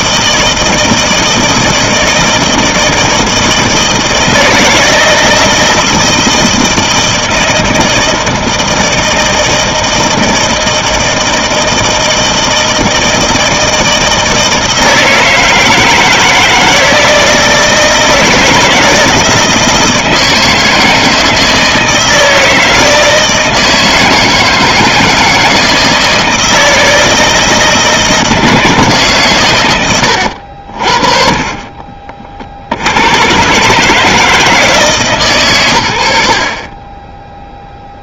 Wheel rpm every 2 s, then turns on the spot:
160, 160, 160, 160, 160, 160, 160, 160, 160, 160, 160, 160, 160, 160, 160, 60, 70, 150, 30.
none